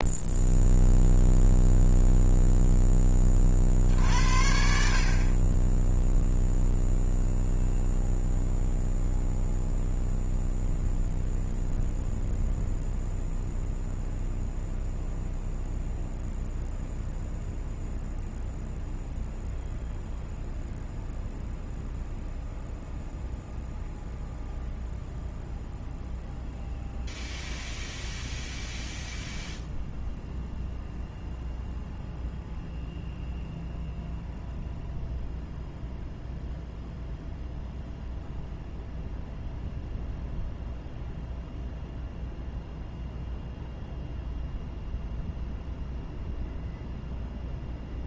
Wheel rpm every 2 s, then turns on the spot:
0, 10, 50, 0, 0, 0, 0, 0, 0, 0, 0, 0, 0, 0, 0, 0, 0, 0, 0, 0, 0, 0, 0, 0.
none